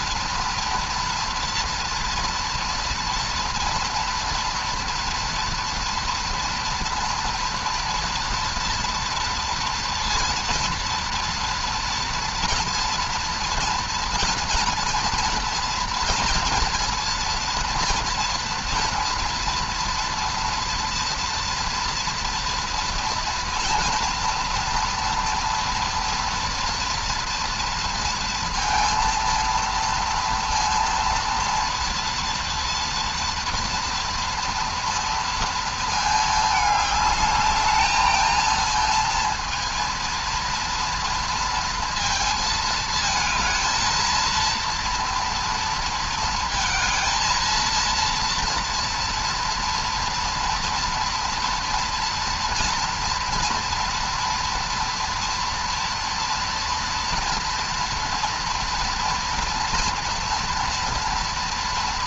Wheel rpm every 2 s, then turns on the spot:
230, 230, 230, 230, 230, 230, 240, 230, 230, 230, 230, 230, 230, 230, 230, 230, 230, 230, 210, 230, 230, 220, 230, 230, 230, 230, 230, 230, 230, 230, 230.
none